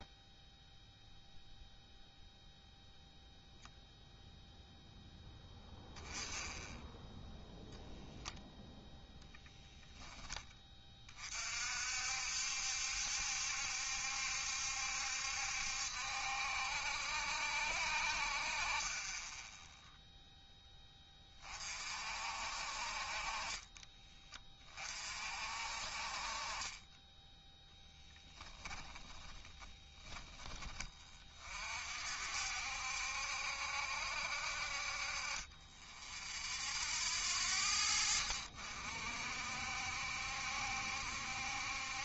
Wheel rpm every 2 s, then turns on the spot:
0, 0, 0, 0, 0, 30, 70, 70, 60, 30, 10, 40, 40, 20, 10, 30, 70, 40, 0, 60, 70.
26-30